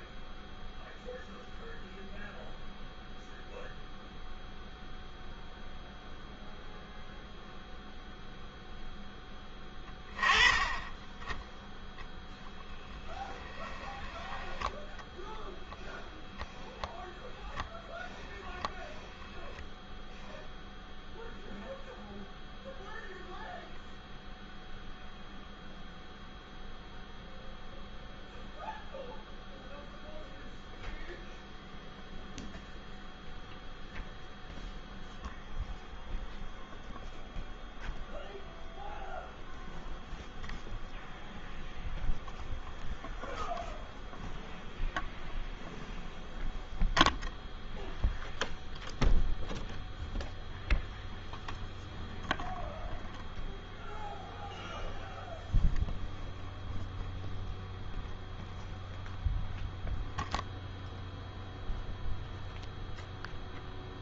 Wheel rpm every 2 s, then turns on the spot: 0, 0, 0, 0, 10, 10, 10, 0, 0, 10, 0, 0, 0, 0, 0, 0, 0, 0, 0, 0, 0, 0, 0, 0, 0, 0, 0, 0, 0, 0, 0, 0.
12-14